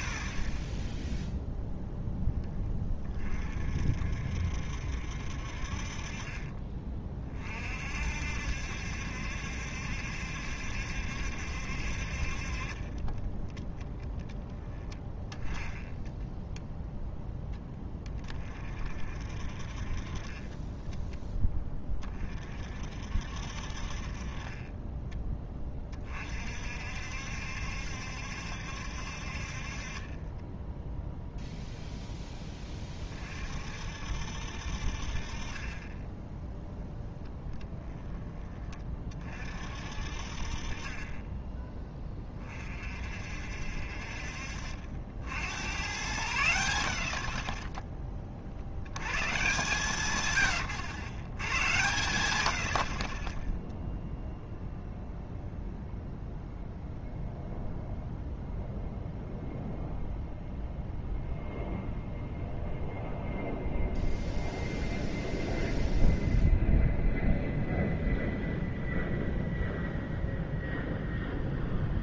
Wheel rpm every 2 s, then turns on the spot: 10, 20, 70, 30, 60, 70, 30, 10, 0, 50, 40, 50, 30, 50, 70, 10, 10, 60, 0, 20, 40, 40, 60, 80, 50, 100, 80, 0, 0, 0, 0, 0, 0, 0, 0, 0.
20-22 50-52